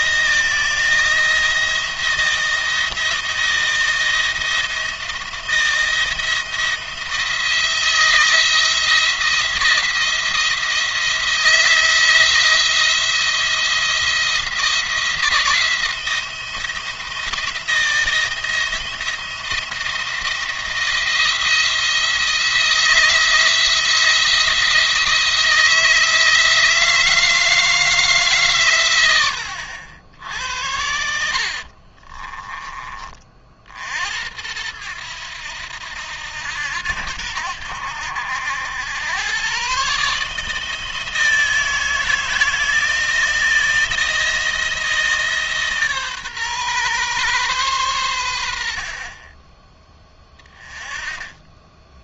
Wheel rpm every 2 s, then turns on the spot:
170, 170, 170, 170, 170, 170, 170, 160, 170, 160, 170, 170, 170, 160, 120, 80, 30, 90, 80, 80, 160, 170, 160, 130, 60, 20.
30-32